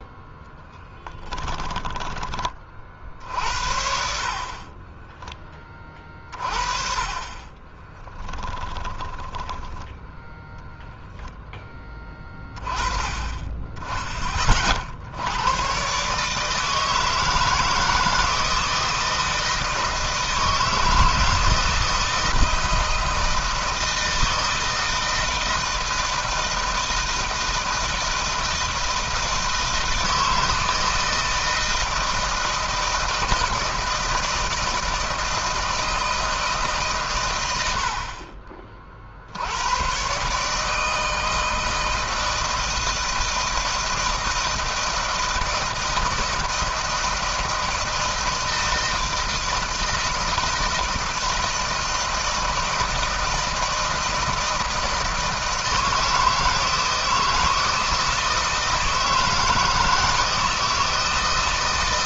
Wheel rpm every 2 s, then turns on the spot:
0, 30, 40, 40, 10, 0, 20, 30, 150, 160, 160, 160, 160, 160, 160, 160, 160, 160, 150, 50, 150, 160, 160, 160, 160, 160, 160, 160, 160, 160, 160.
4-6 8-10